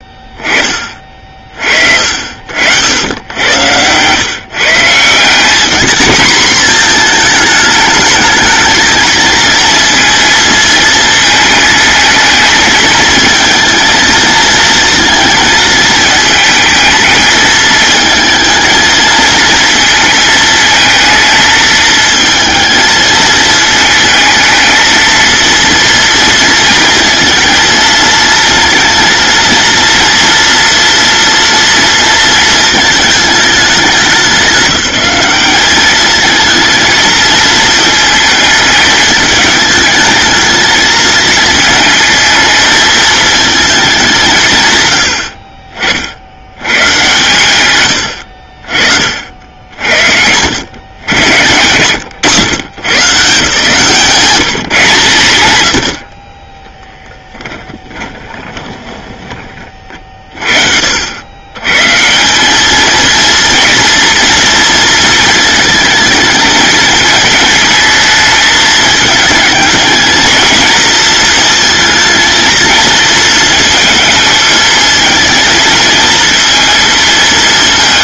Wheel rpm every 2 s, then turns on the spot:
30, 90, 160, 220, 230, 220, 220, 220, 220, 230, 220, 220, 220, 230, 230, 230, 220, 180, 230, 210, 220, 220, 110, 130, 50, 110, 150, 130, 10, 20, 60, 220, 230, 220, 220, 230, 230, 220, 230.
56-60